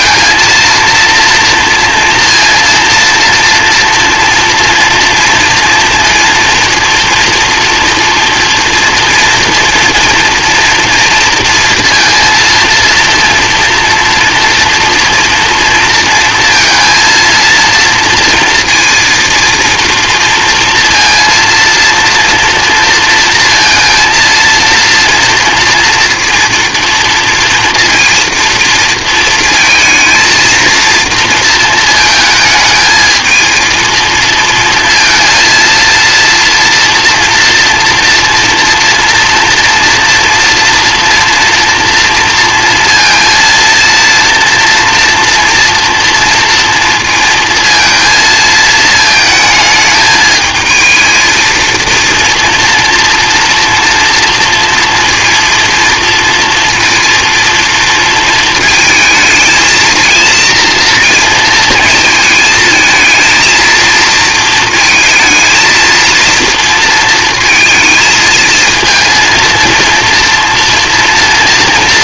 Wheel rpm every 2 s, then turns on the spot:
230, 230, 230, 230, 230, 240, 230, 230, 230, 230, 230, 230, 230, 230, 230, 230, 220, 230, 230, 230, 240, 230, 240, 230, 220, 220, 230, 230, 230, 220, 230, 220, 230, 230, 230, 230.
none